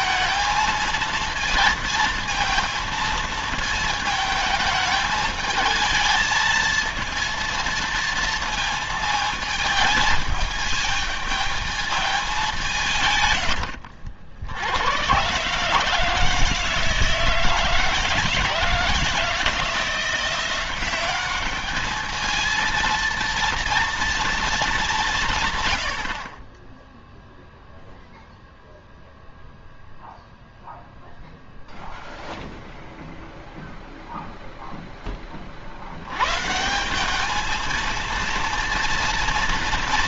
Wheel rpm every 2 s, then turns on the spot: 220, 220, 220, 220, 220, 220, 180, 90, 160, 160, 180, 230, 210, 20, 0, 0, 0, 0, 160, 230.
none